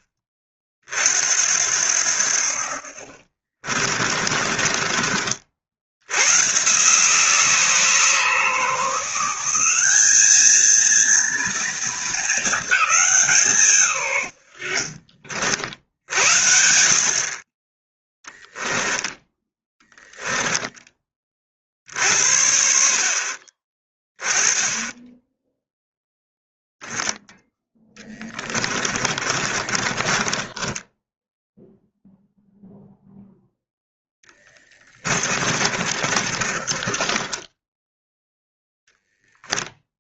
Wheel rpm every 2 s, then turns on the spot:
40, 60, 30, 140, 160, 230, 210, 80, 50, 10, 10, 70, 20, 0, 20, 10, 0, 20, 30, 0.
2-6 14-16 18-20 28-32 34-38